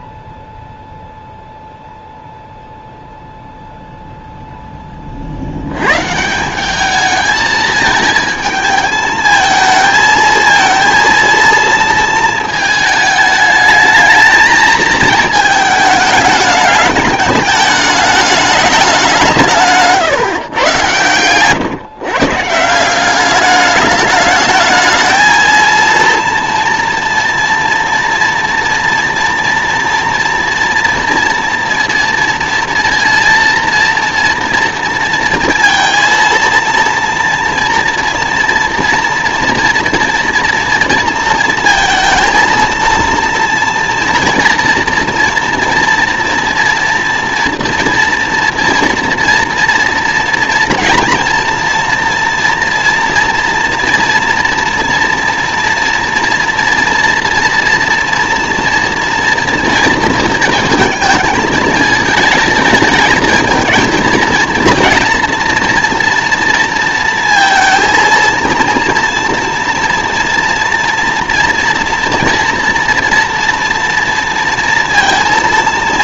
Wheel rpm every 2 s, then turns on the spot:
0, 0, 0, 190, 220, 230, 220, 220, 210, 210, 120, 160, 220, 230, 230, 230, 230, 230, 230, 230, 230, 230, 230, 230, 230, 230, 230, 230, 230, 230, 220, 220, 230, 230, 230, 240, 230, 230.
none